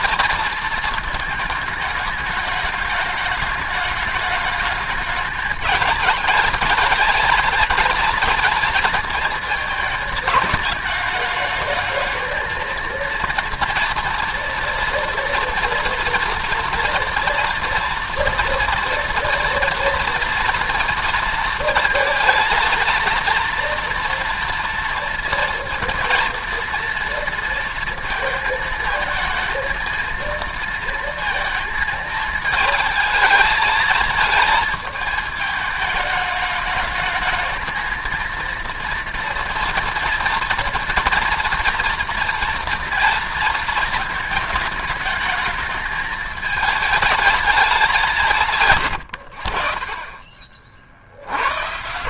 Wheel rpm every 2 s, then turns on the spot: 220, 210, 210, 220, 230, 210, 230, 230, 230, 230, 230, 230, 230, 230, 220, 230, 220, 220, 220, 230, 230, 230, 210, 220, 140, 50.
48-50